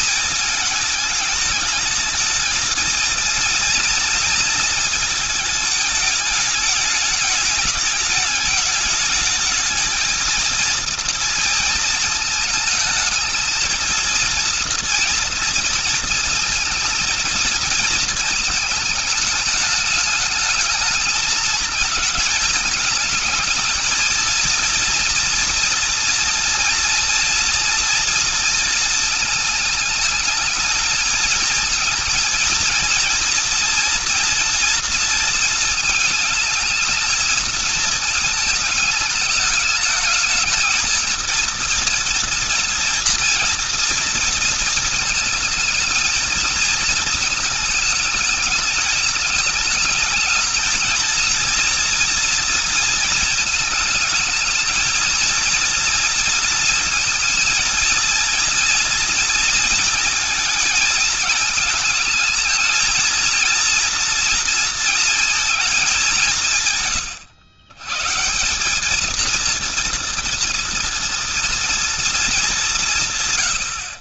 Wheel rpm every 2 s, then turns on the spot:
220, 230, 220, 210, 210, 230, 220, 230, 230, 220, 210, 220, 230, 230, 230, 220, 230, 230, 220, 220, 220, 230, 230, 220, 210, 220, 230, 220, 230, 230, 230, 230, 230, 140, 200, 230, 170.
none